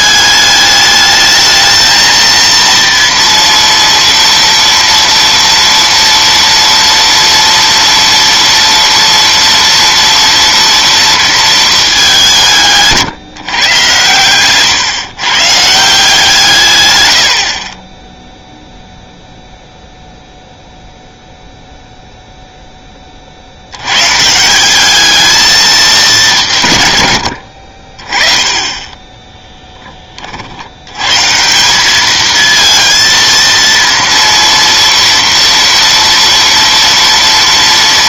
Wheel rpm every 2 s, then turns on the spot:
210, 230, 230, 230, 230, 230, 160, 120, 130, 0, 0, 0, 170, 150, 20, 70, 220, 230, 230.
none